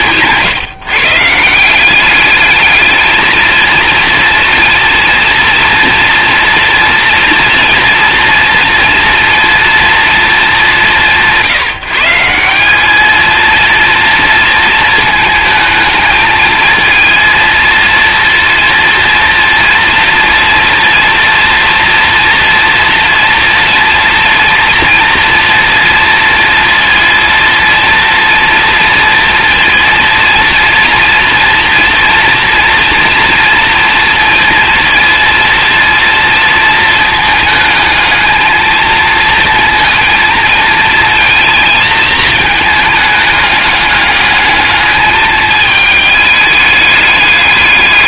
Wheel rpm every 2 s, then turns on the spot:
150, 210, 230, 230, 230, 190, 200, 230, 220, 230, 230, 230, 230, 230, 230, 230, 230, 230, 220, 220, 230, 220, 210, 210.
none